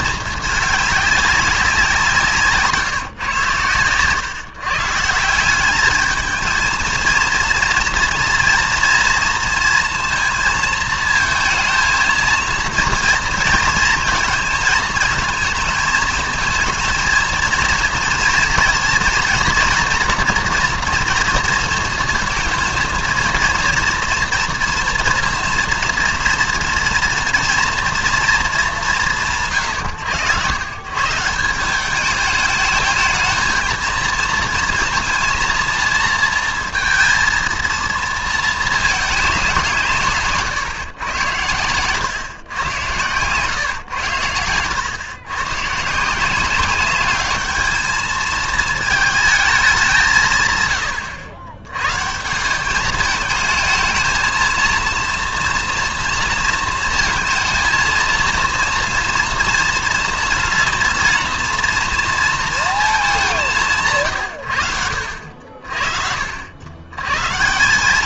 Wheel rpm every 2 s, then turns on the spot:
220, 160, 140, 230, 230, 230, 230, 230, 230, 230, 230, 230, 230, 230, 200, 130, 210, 230, 230, 220, 130, 110, 100, 200, 220, 130, 200, 220, 230, 230, 230, 220, 90, 90.
2-4